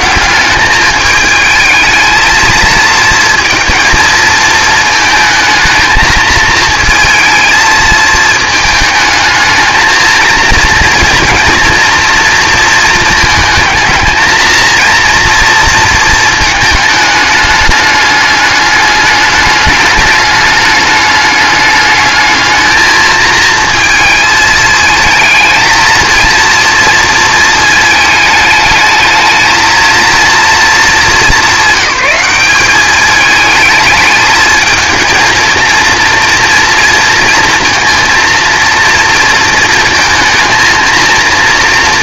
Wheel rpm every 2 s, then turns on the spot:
210, 230, 220, 230, 220, 230, 220, 230, 220, 210, 210, 220, 220, 230, 210, 210, 200, 220, 240, 230, 230.
none